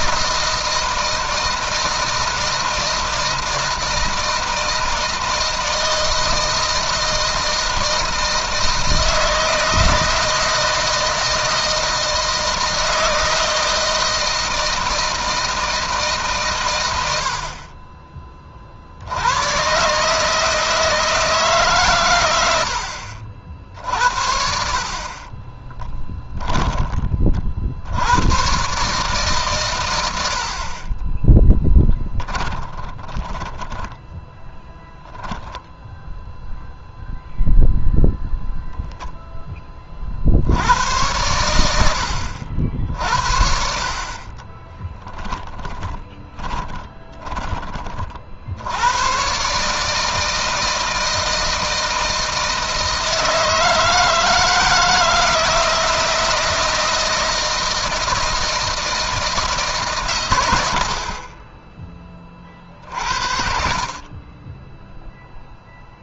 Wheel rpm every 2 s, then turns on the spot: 160, 160, 160, 160, 160, 160, 160, 160, 100, 70, 160, 70, 40, 30, 140, 30, 20, 0, 0, 0, 100, 60, 10, 10, 100, 160, 160, 170, 170, 160, 70, 40, 0.
24-26 30-34 44-48